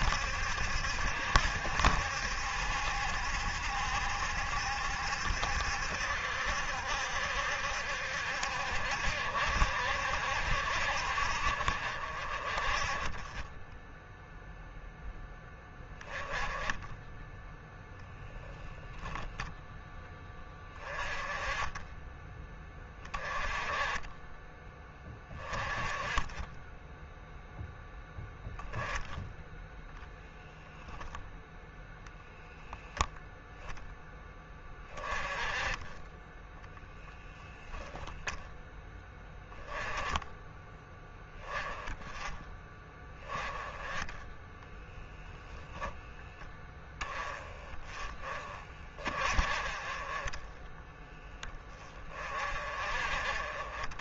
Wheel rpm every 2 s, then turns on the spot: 70, 70, 70, 70, 60, 60, 40, 0, 10, 0, 20, 20, 20, 10, 0, 0, 0, 20, 10, 0, 10, 10, 10, 10, 30, 20, 40.
36-38 44-46